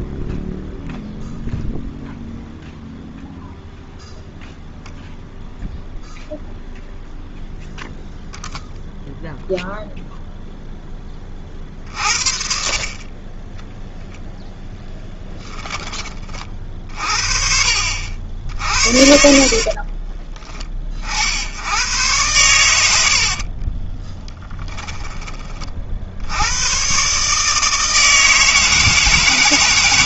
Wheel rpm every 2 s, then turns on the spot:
0, 0, 0, 0, 0, 30, 20, 10, 40, 50, 60, 60, 20, 140, 150.
14-16 18-20 22-24